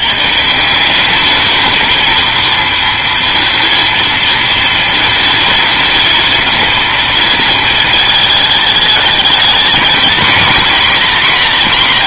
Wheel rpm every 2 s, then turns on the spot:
170, 230, 220, 230, 210, 230.
none